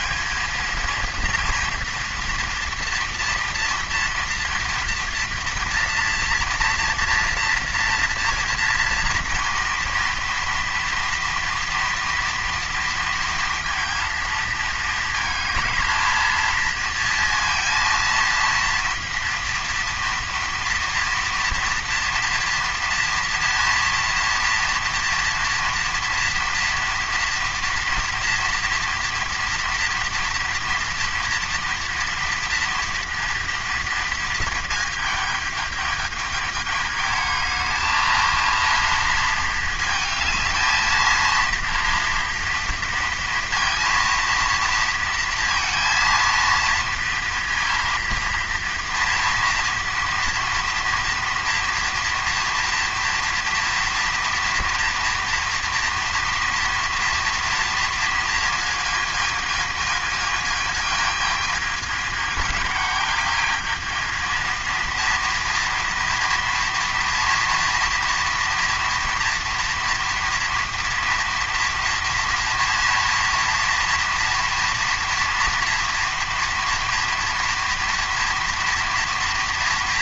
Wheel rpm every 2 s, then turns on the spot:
230, 230, 230, 230, 230, 230, 230, 220, 230, 230, 230, 230, 230, 230, 230, 230, 230, 220, 220, 220, 230, 230, 230, 230, 230, 230, 230, 230, 230, 220, 220, 210, 230, 230, 230, 230, 230, 230, 230, 230.
none